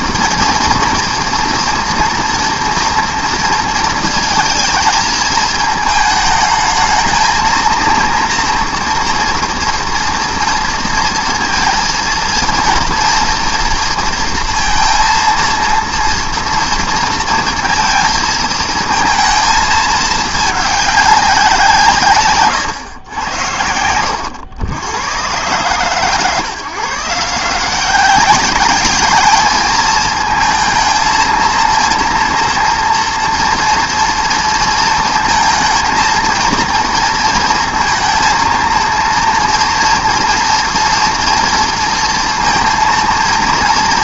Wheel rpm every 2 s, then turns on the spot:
230, 230, 220, 220, 230, 230, 230, 230, 230, 230, 210, 110, 80, 150, 210, 220, 230, 230, 230, 230, 230, 230.
none